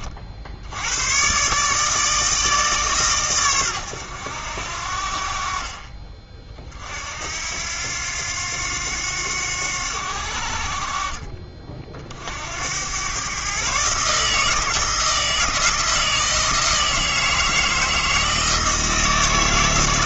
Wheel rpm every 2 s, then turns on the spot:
90, 150, 70, 50, 90, 50, 90, 160, 160, 160.
none